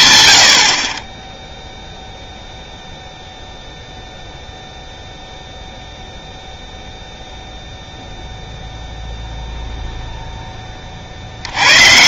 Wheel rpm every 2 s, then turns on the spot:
80, 0, 0, 0, 0, 10.
none